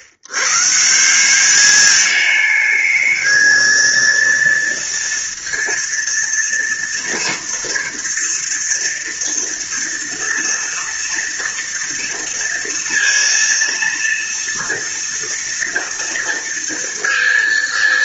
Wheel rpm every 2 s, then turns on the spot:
120, 210, 230, 230, 230, 230, 230, 230, 230.
none